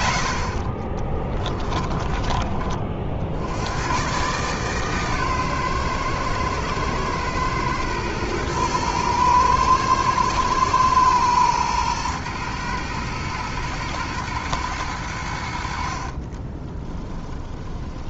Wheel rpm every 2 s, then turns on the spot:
60, 50, 140, 110, 110, 120, 110, 100, 20.
16-18